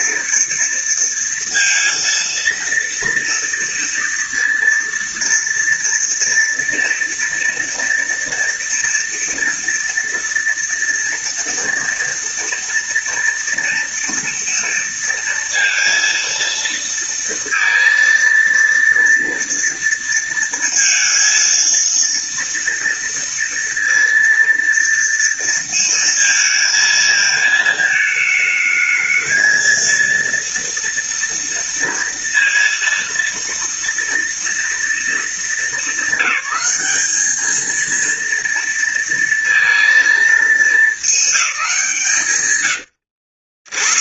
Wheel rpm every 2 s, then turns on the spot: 230, 230, 230, 230, 240, 230, 230, 230, 230, 230, 230, 230, 230, 220, 220, 230, 230, 230, 200, 230, 210, 70.
42-44